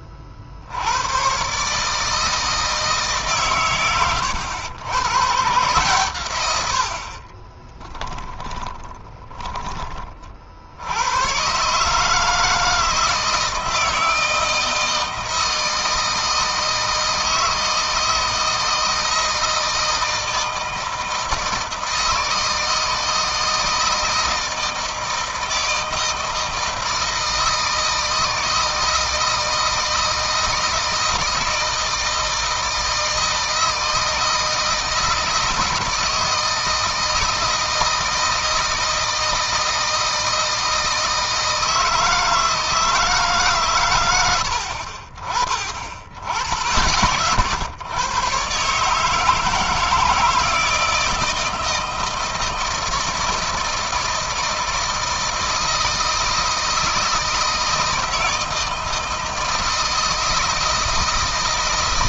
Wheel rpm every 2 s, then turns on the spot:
70, 160, 100, 100, 20, 70, 160, 160, 160, 160, 160, 160, 160, 160, 160, 160, 160, 160, 160, 160, 160, 160, 70, 50, 140, 160, 160, 160, 160, 160, 160.
8-10